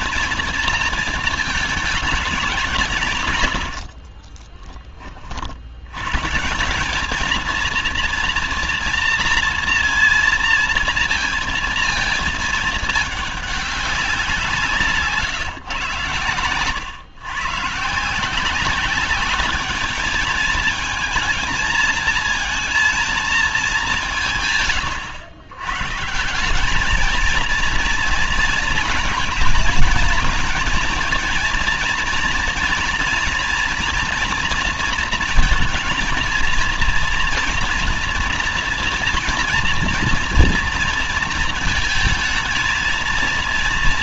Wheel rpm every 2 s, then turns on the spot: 230, 180, 20, 170, 240, 230, 220, 170, 120, 180, 220, 230, 130, 190, 220, 230, 230, 230, 230, 230, 230, 220.
none